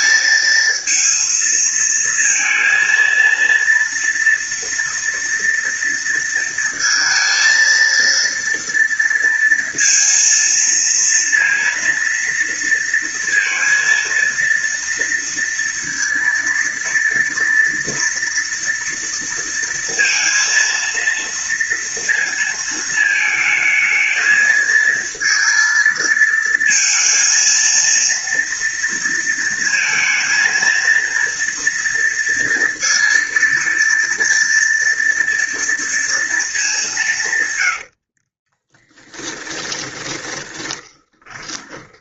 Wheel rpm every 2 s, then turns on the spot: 230, 230, 230, 230, 230, 230, 230, 230, 230, 240, 230, 230, 220, 220, 230, 230, 230, 230, 210, 30, 20.
38-42